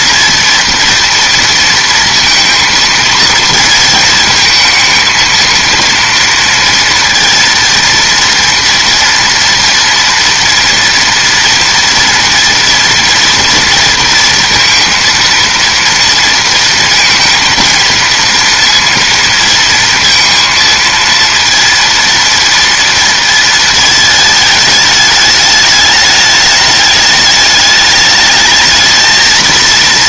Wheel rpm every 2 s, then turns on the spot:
230, 220, 220, 230, 230, 230, 230, 230, 230, 230, 230, 230, 210, 210, 220.
none